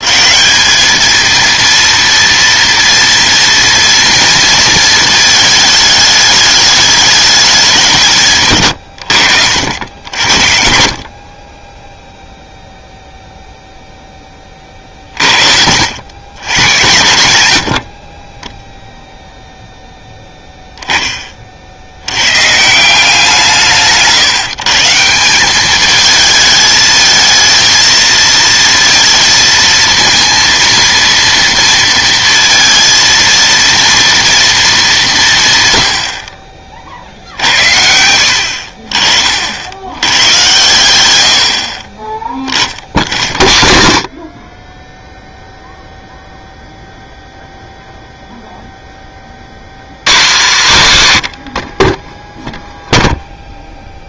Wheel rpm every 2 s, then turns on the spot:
200, 240, 230, 210, 110, 50, 0, 40, 110, 0, 10, 150, 150, 220, 230, 230, 230, 220, 50, 60, 110, 30, 20, 0, 0, 180, 0.
none